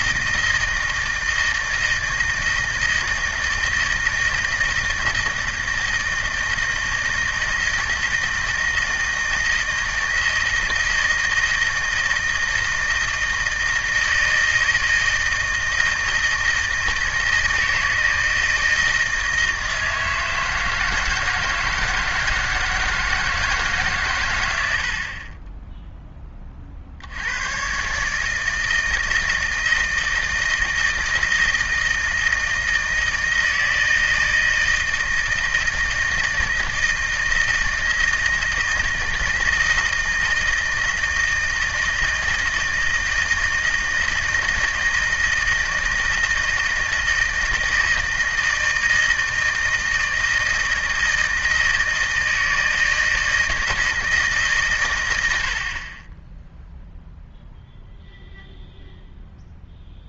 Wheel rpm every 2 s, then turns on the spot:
160, 160, 160, 160, 160, 170, 160, 160, 160, 160, 160, 160, 90, 50, 160, 170, 160, 160, 160, 160, 160, 160, 160, 160, 160, 160, 160, 130, 0, 0.
none